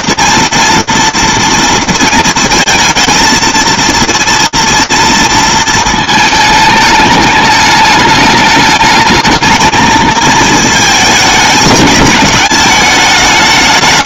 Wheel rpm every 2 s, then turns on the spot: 220, 230, 230, 220, 210, 220, 210.
none